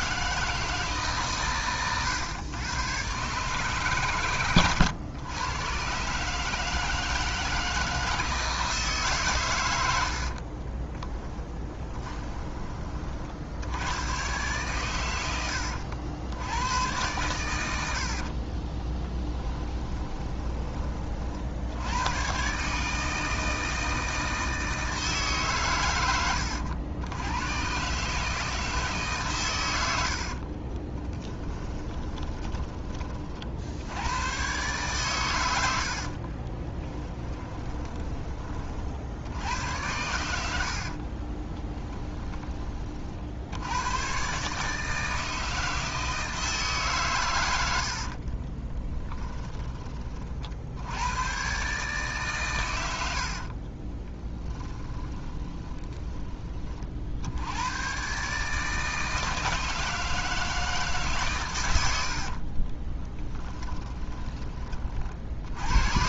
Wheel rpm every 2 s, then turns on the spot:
160, 120, 110, 160, 160, 30, 30, 120, 100, 30, 30, 150, 160, 90, 160, 30, 30, 130, 20, 50, 60, 40, 150, 150, 20, 80, 100, 10, 30, 150, 150, 30, 30.
10-12 18-20 30-32 36-38 40-42 48-50 54-56 62-64